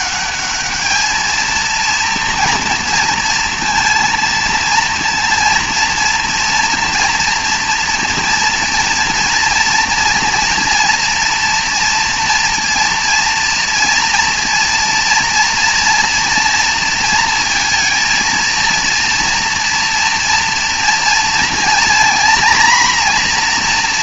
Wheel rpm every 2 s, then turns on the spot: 210, 230, 230, 230, 230, 230, 230, 230, 230, 230, 240, 240.
none